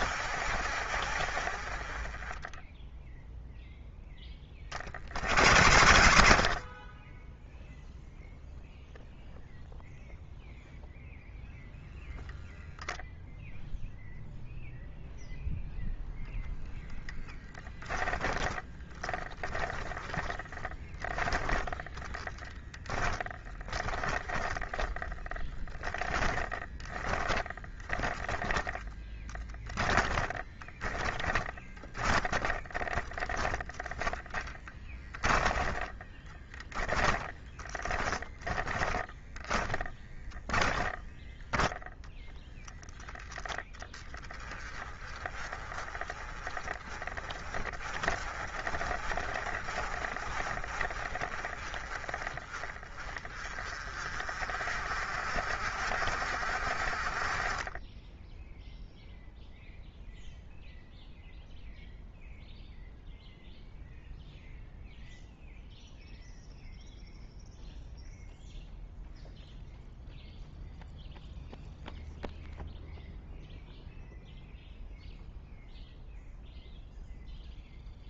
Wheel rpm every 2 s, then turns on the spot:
60, 10, 40, 40, 0, 0, 0, 0, 10, 10, 10, 10, 10, 10, 10, 10, 30, 10, 20, 10, 10, 0, 20, 20, 30, 40, 30, 40, 40, 0, 0, 0, 0, 0, 0, 0, 0, 0, 0.
18-42